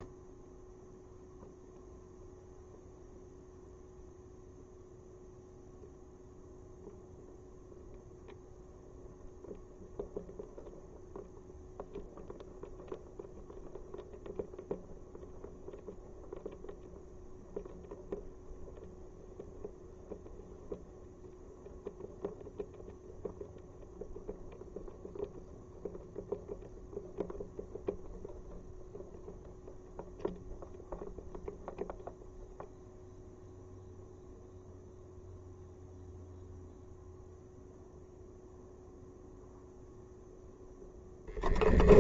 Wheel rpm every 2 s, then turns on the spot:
0, 0, 0, 0, 0, 0, 0, 0, 0, 0, 0, 0, 0, 0, 0, 0, 0, 0, 0, 0, 0.
none